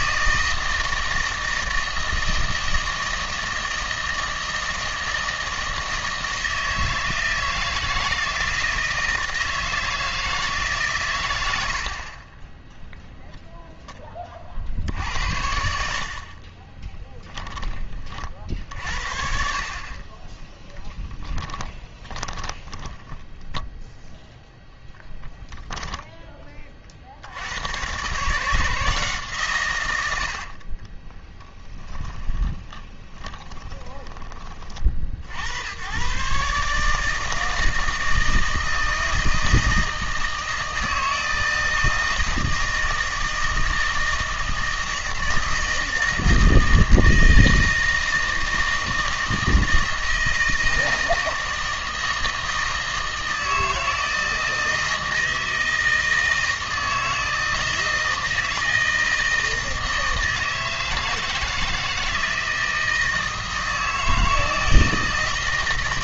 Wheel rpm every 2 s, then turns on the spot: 160, 160, 160, 160, 160, 150, 10, 50, 20, 50, 10, 10, 10, 30, 150, 40, 10, 30, 150, 160, 160, 160, 160, 160, 160, 160, 160, 160, 160, 160, 160, 160, 160.
16-18 20-24 30-34